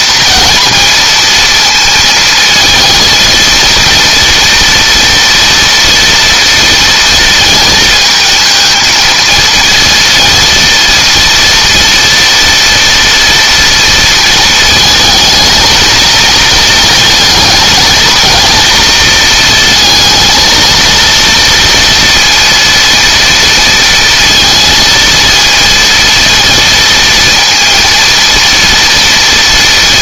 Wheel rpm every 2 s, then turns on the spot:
230, 220, 230, 230, 230, 230, 240, 220, 220, 230, 230, 230, 230, 230, 230.
none